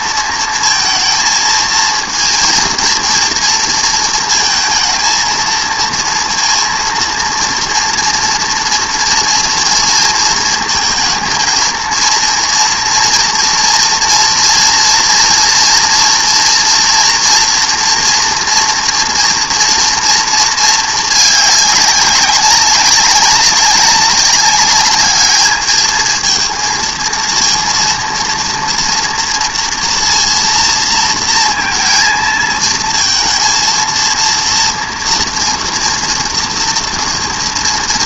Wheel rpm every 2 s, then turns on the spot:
230, 230, 230, 230, 230, 230, 230, 230, 230, 240, 220, 190, 200, 230, 240, 230, 230, 230, 230.
none